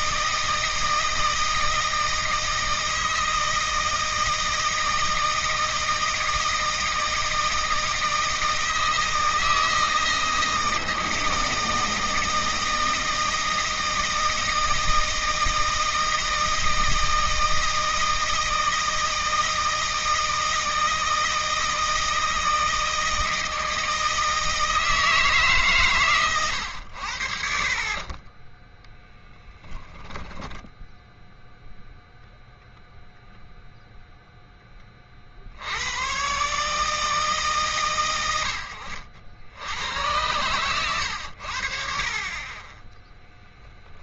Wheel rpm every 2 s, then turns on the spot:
160, 160, 160, 160, 160, 160, 160, 160, 160, 160, 160, 160, 160, 90, 10, 0, 0, 30, 140, 90, 90, 30.
28-30 42-44